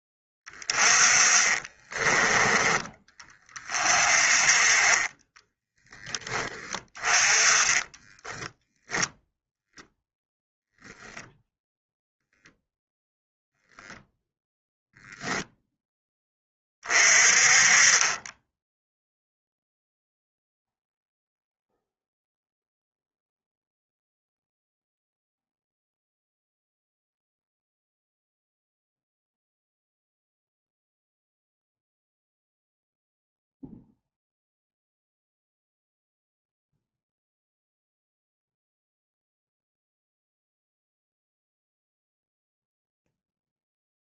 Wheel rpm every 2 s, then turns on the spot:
20, 20, 30, 30, 0, 0, 0, 10, 30, 10, 0, 0, 0, 0, 0, 0, 0, 0, 0, 0, 0, 0.
0-2